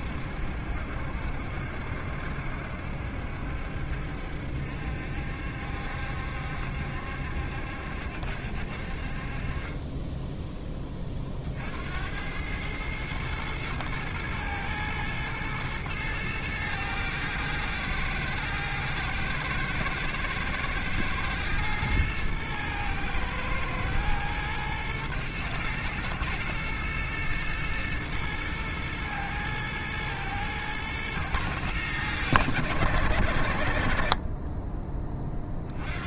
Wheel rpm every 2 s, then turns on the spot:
70, 70, 70, 70, 60, 20, 110, 120, 110, 110, 110, 110, 110, 110, 110, 110, 100, 20.
none